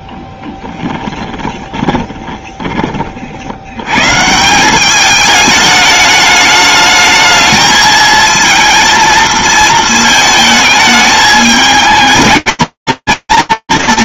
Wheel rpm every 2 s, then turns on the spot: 10, 10, 170, 210, 230, 220, 130.
0-2